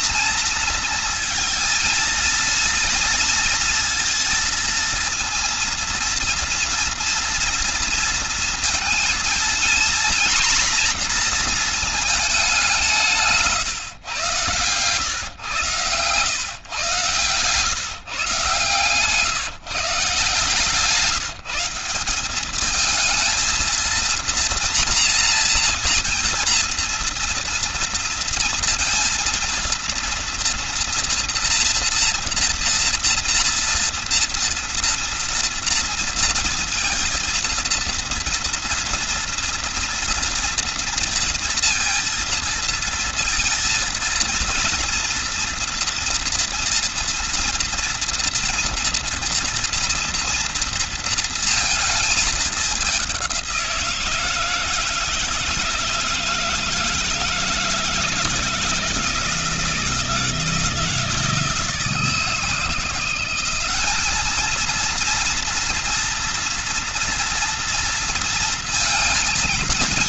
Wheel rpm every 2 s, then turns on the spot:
230, 230, 230, 230, 230, 230, 130, 130, 130, 150, 170, 230, 230, 230, 230, 230, 230, 230, 230, 230, 230, 230, 230, 230, 230, 230, 190, 160, 160, 170, 160, 180, 230, 230, 230.
14-16